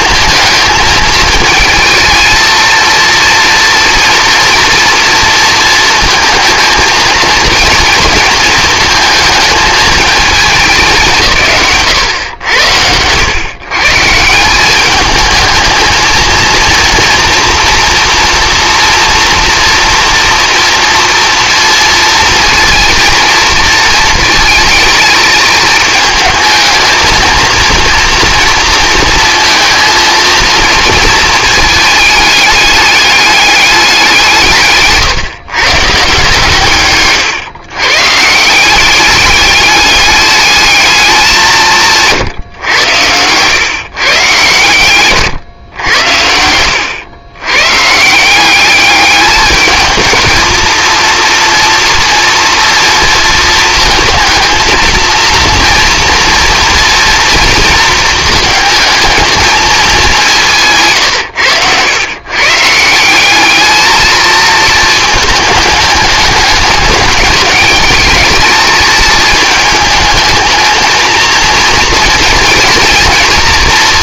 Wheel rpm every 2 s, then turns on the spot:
220, 230, 230, 230, 230, 190, 100, 200, 230, 230, 230, 230, 220, 220, 230, 230, 210, 160, 140, 190, 210, 110, 120, 90, 200, 220, 230, 230, 230, 220, 150, 160, 230, 210, 220, 220, 230.
none